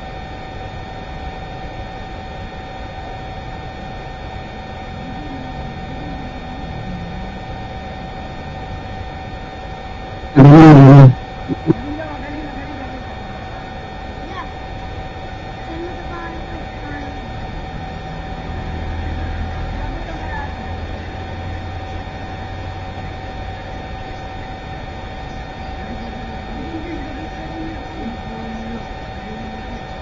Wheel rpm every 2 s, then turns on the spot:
0, 0, 0, 0, 0, 0, 0, 0, 0, 0, 0, 0, 0, 0, 0.
none